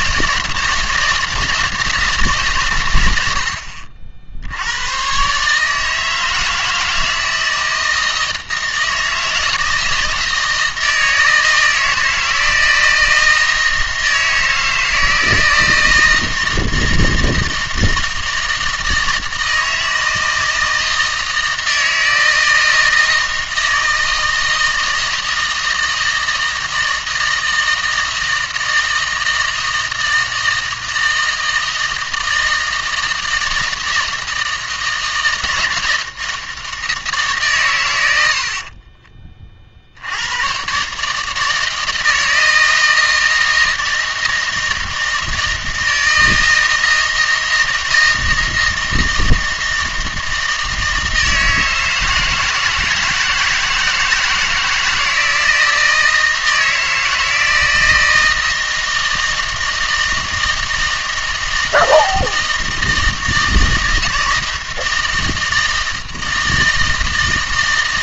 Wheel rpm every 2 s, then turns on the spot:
160, 120, 90, 160, 160, 160, 160, 160, 160, 160, 160, 160, 160, 160, 160, 160, 160, 160, 160, 40, 140, 160, 160, 160, 160, 160, 160, 160, 160, 160, 160, 160, 160, 160.
38-40